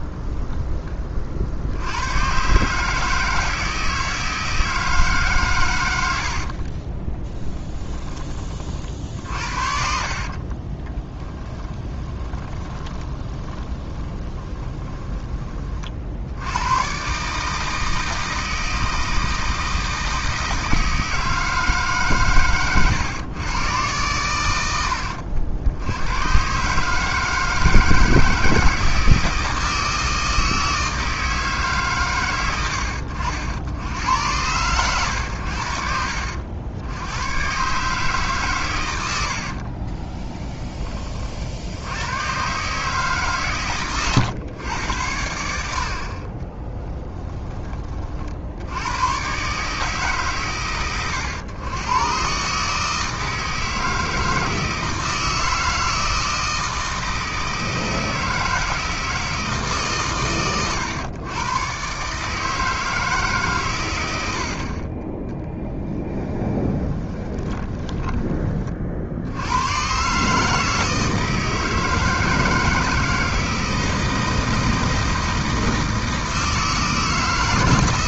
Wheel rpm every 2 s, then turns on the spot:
20, 150, 160, 40, 40, 20, 20, 20, 120, 160, 160, 110, 80, 150, 160, 160, 80, 110, 90, 110, 20, 150, 100, 10, 90, 120, 150, 160, 160, 160, 120, 160, 40, 20, 50, 160, 160, 160, 160.
6-8 10-16 22-26 46-48 66-68